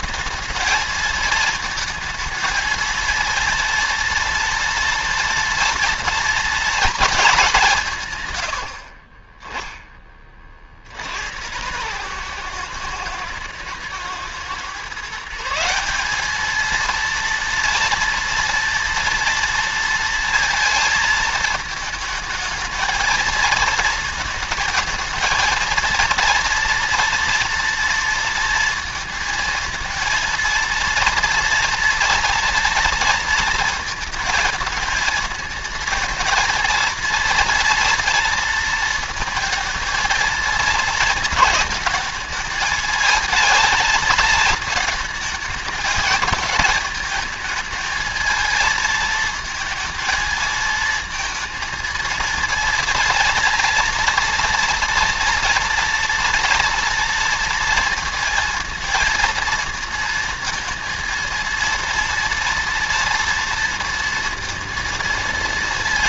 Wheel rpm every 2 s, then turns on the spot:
220, 230, 230, 210, 50, 70, 120, 150, 230, 230, 220, 220, 220, 230, 230, 230, 230, 220, 230, 230, 220, 220, 220, 220, 220, 220, 230, 230, 230, 230, 230, 230, 230.
8-10